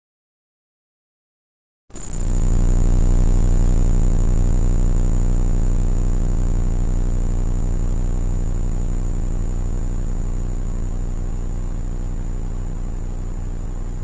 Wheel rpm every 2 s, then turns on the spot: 0, 0, 0, 0, 0, 0, 0.
none